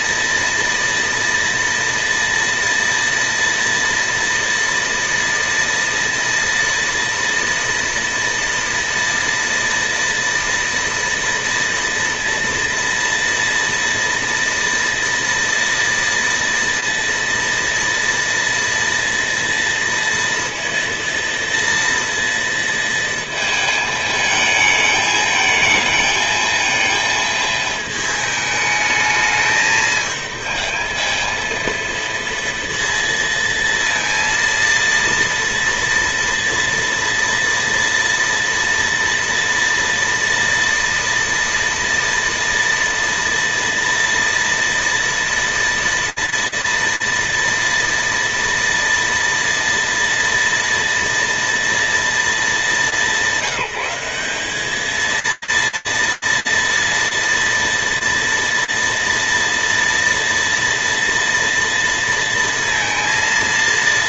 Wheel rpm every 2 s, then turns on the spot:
230, 230, 230, 240, 230, 230, 230, 240, 230, 230, 230, 230, 220, 220, 210, 220, 230, 230, 230, 230, 240, 230, 230, 230, 230, 240, 180, 220, 230, 230, 240, 230.
none